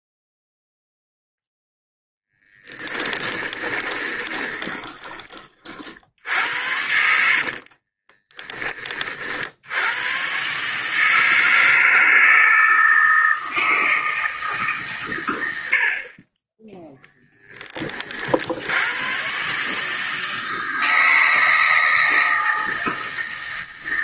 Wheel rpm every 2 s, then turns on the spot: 0, 10, 20, 70, 40, 150, 160, 130, 0, 100, 160, 160.
2-4 6-8